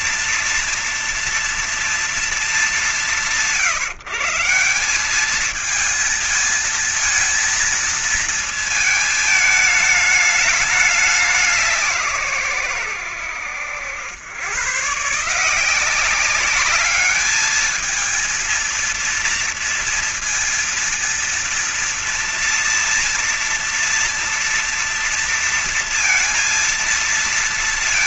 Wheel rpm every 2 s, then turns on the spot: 240, 190, 150, 230, 230, 210, 150, 110, 190, 230, 230, 230, 230, 230.
none